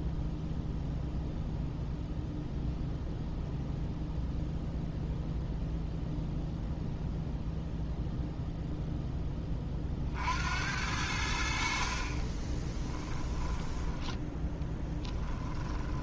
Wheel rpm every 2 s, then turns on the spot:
0, 0, 0, 0, 0, 80, 10, 10.
12-14